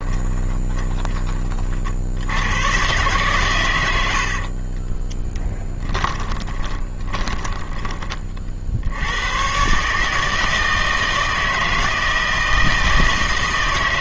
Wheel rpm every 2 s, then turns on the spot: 10, 110, 30, 20, 50, 160, 160.
0-2 4-8